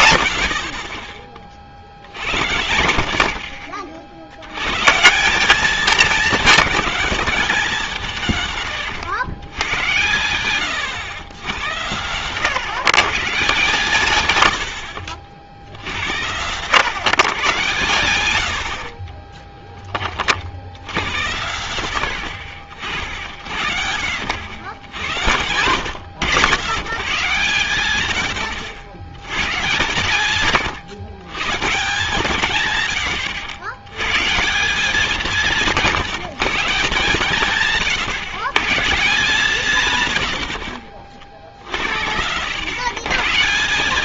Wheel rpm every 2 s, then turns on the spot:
50, 80, 110, 220, 130, 120, 140, 90, 120, 80, 80, 70, 100, 140, 70, 130, 120, 180, 150, 140, 70, 130.
none